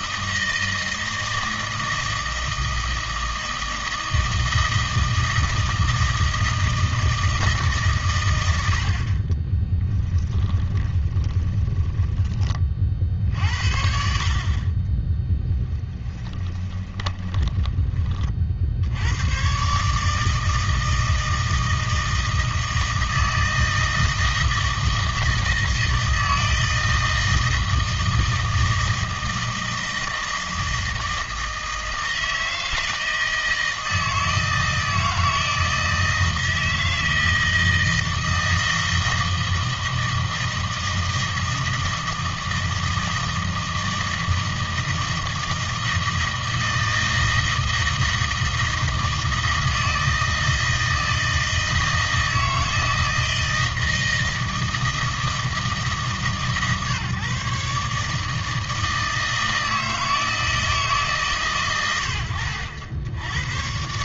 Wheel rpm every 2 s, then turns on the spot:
160, 160, 160, 160, 90, 10, 40, 40, 20, 60, 160, 160, 160, 160, 160, 160, 160, 160, 160, 160, 160, 160, 160, 160, 160, 160, 160, 160, 140, 160, 160, 90.
10-12 16-18